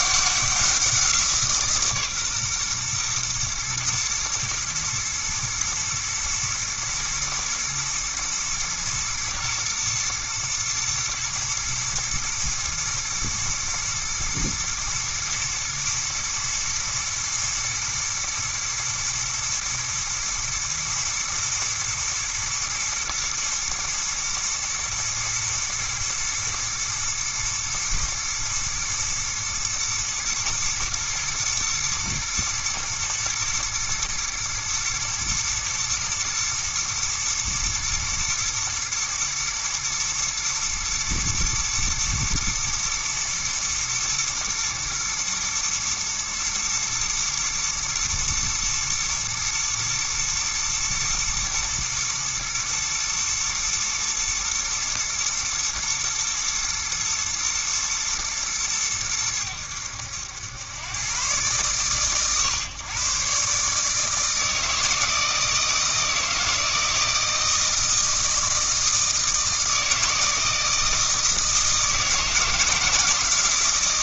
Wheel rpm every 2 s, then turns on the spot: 180, 130, 110, 110, 110, 110, 120, 110, 120, 120, 110, 110, 120, 110, 120, 110, 110, 120, 110, 110, 110, 120, 110, 120, 110, 110, 110, 120, 120, 110, 100, 130, 160, 160, 160, 160, 160.
none